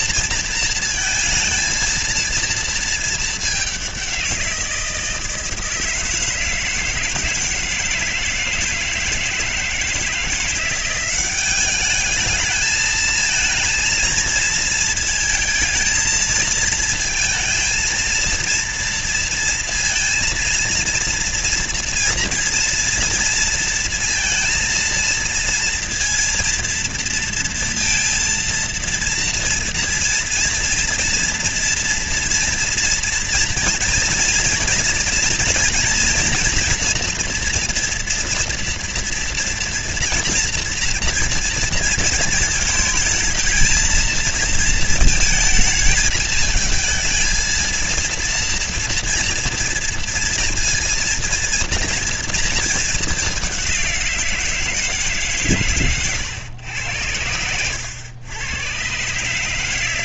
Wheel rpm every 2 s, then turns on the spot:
230, 220, 170, 160, 160, 180, 220, 220, 220, 230, 230, 230, 230, 230, 230, 230, 230, 230, 240, 230, 240, 220, 230, 220, 230, 230, 230, 170, 100, 90.
none